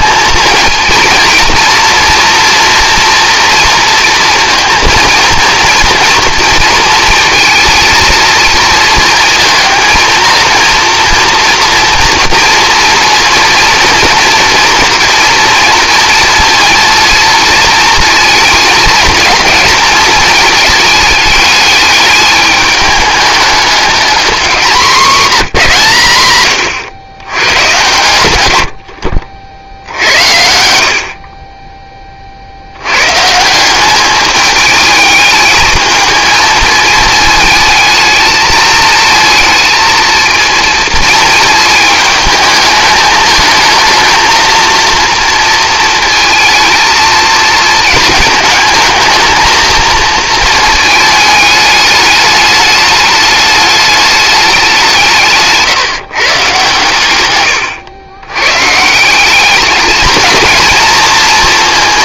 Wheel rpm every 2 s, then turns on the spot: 220, 230, 230, 230, 230, 230, 230, 240, 230, 220, 210, 210, 200, 120, 80, 70, 80, 210, 220, 220, 230, 210, 230, 230, 220, 220, 210, 190, 130, 130, 230.
30-32